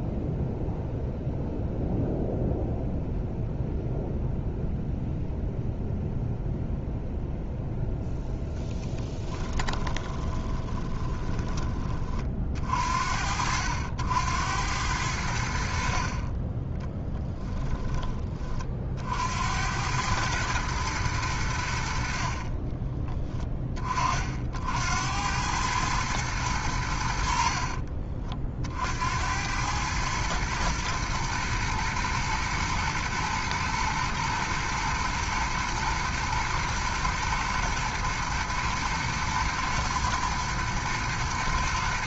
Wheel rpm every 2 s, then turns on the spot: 0, 0, 0, 0, 10, 10, 50, 90, 10, 50, 110, 20, 70, 90, 60, 110, 110, 110, 120, 120, 110.
8-12 16-18 22-24